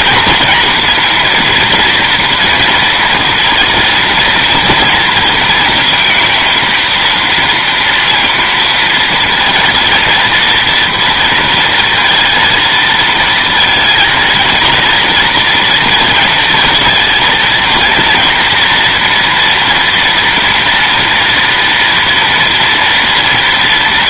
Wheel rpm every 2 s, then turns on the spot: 230, 230, 230, 230, 230, 230, 230, 230, 230, 230, 230, 230.
none